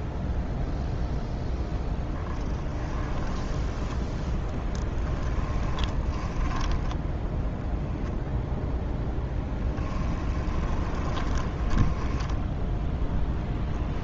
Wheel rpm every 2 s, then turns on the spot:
0, 10, 10, 10, 0, 20, 0.
2-8 10-12